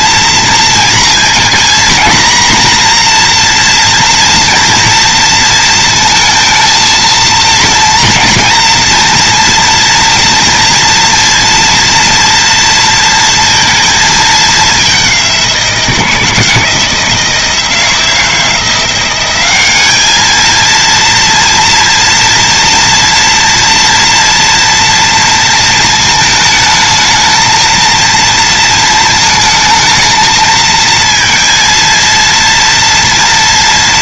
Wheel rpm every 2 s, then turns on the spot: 230, 240, 230, 230, 240, 230, 230, 200, 160, 180, 230, 230, 230, 220, 220, 230, 230.
none